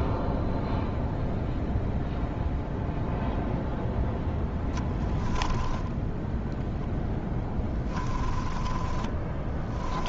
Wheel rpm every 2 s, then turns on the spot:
0, 0, 10, 0, 20.
4-6 8-10